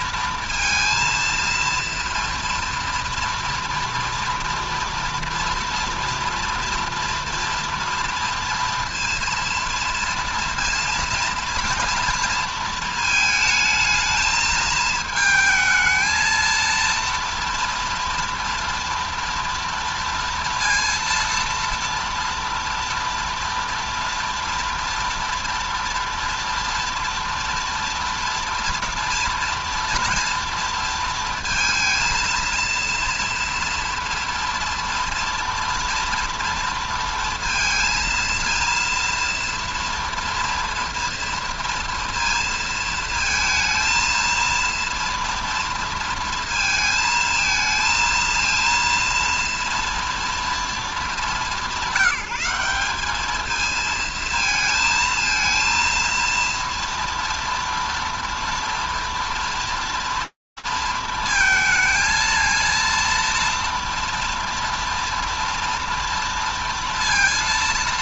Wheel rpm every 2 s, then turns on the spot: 230, 230, 230, 230, 230, 230, 230, 220, 230, 230, 230, 230, 230, 230, 230, 230, 230, 230, 230, 230, 230, 230, 230, 230, 230, 230, 200, 220, 230, 230, 230, 230, 230, 230.
none